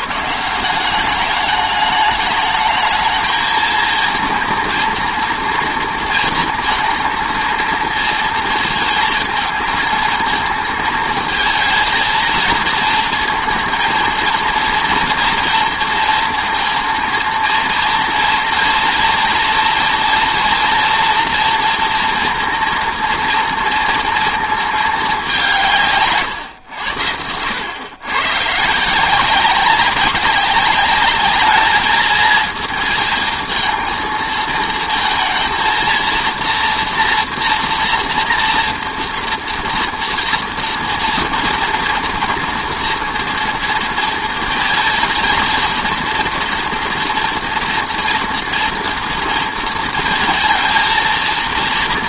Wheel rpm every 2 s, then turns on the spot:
180, 220, 230, 230, 230, 230, 230, 230, 230, 230, 230, 230, 220, 100, 150, 200, 230, 220, 230, 240, 230, 230, 230, 230, 230, 230.
none